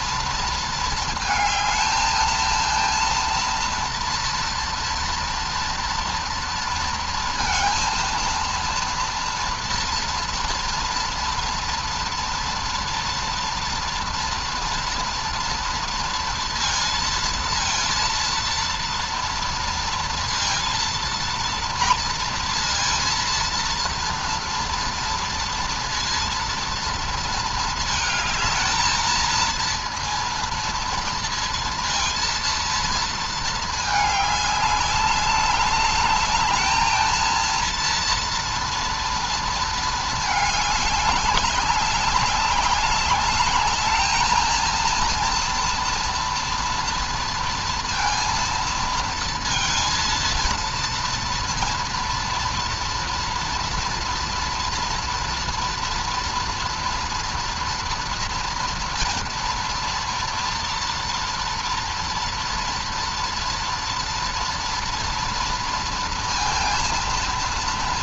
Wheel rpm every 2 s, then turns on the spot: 230, 220, 230, 230, 230, 230, 230, 230, 230, 230, 230, 230, 230, 230, 220, 230, 230, 200, 210, 230, 210, 190, 220, 230, 230, 230, 230, 230, 230, 230, 230, 230, 230, 230.
none